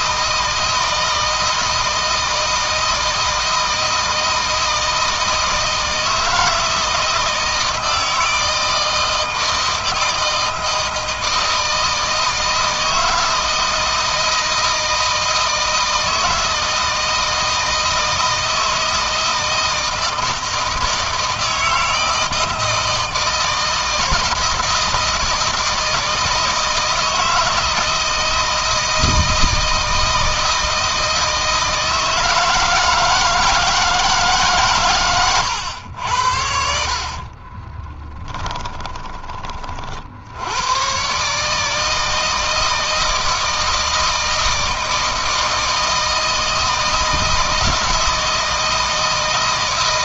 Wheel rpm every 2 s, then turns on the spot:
160, 160, 160, 160, 160, 160, 160, 160, 160, 160, 160, 160, 170, 160, 160, 160, 160, 130, 50, 20, 120, 160, 160, 160, 160.
36-40